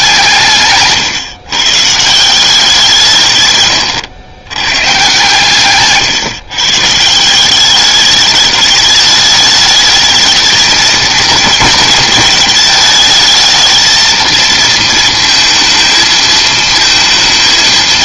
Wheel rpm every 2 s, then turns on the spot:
150, 170, 110, 140, 210, 220, 220, 230, 220.
none